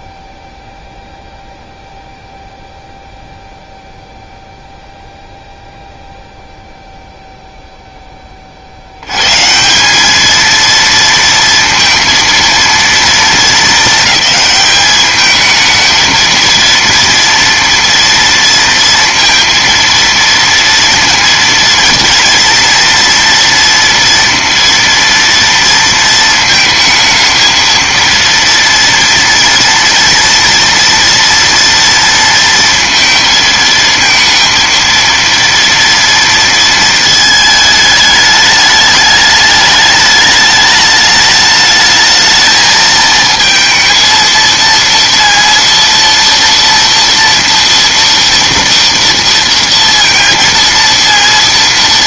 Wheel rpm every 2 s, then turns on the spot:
0, 0, 0, 0, 40, 220, 230, 210, 230, 230, 230, 230, 230, 220, 230, 230, 230, 230, 230, 210, 210, 220, 230, 230, 230, 230.
none